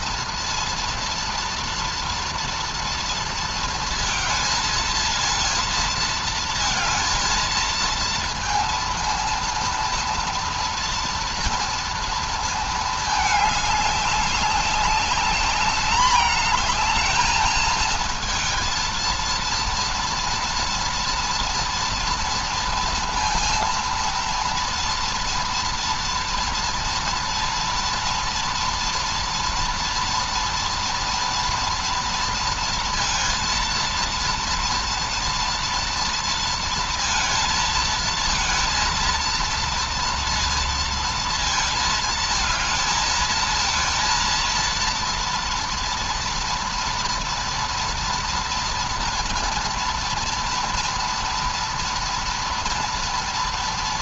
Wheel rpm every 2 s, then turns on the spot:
230, 230, 230, 220, 230, 230, 220, 190, 220, 230, 240, 230, 230, 230, 230, 230, 230, 230, 230, 230, 230, 220, 230, 230, 230, 230, 240.
none